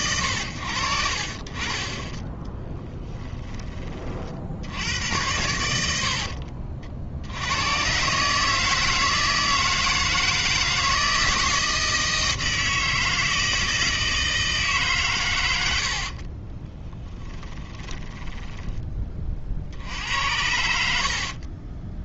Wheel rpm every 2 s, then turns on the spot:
60, 20, 90, 60, 160, 160, 160, 140, 10, 20, 70.
2-4 16-18